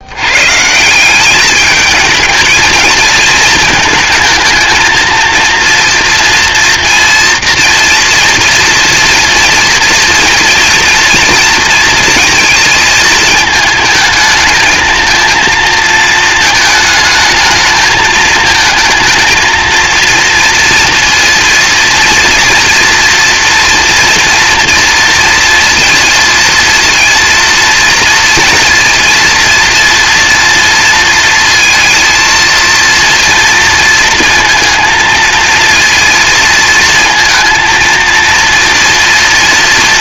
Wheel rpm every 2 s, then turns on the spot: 160, 220, 230, 230, 230, 230, 220, 220, 220, 230, 230, 230, 230, 230, 230, 230, 230, 230, 230, 230.
none